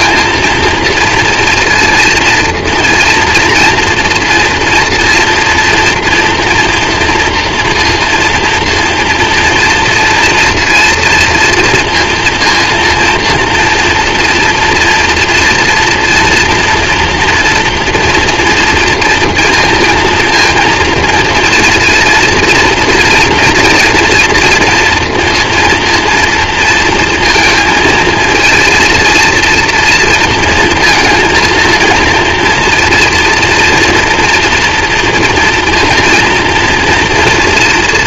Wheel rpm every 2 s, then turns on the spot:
230, 230, 240, 230, 230, 230, 240, 230, 240, 240, 230, 230, 230, 230, 230, 230, 230, 230, 230.
none